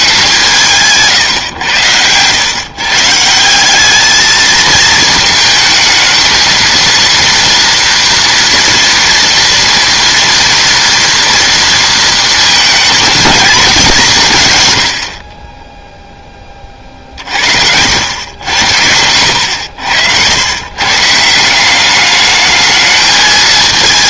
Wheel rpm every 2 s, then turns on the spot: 160, 140, 220, 230, 230, 230, 230, 110, 30, 90, 120, 220.
none